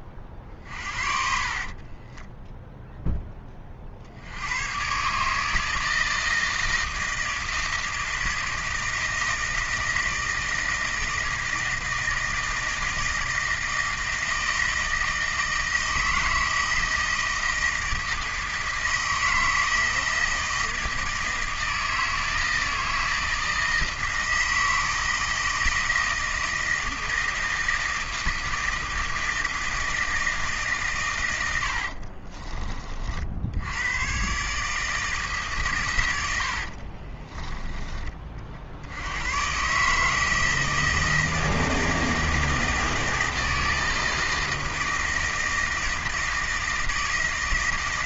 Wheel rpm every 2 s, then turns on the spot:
40, 0, 120, 160, 160, 160, 160, 160, 160, 160, 160, 160, 160, 160, 160, 140, 30, 150, 50, 70, 160, 160, 160, 160.
0-2 36-38